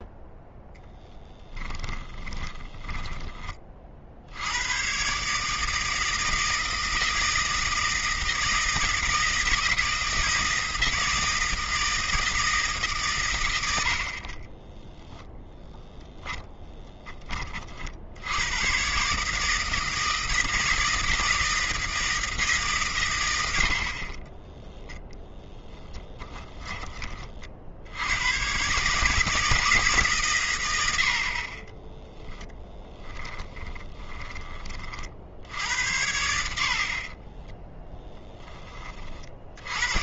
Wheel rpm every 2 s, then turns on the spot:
0, 20, 90, 160, 160, 160, 160, 20, 10, 100, 160, 150, 20, 20, 120, 120, 10, 20, 60, 20.
2-4 14-16 24-28 32-34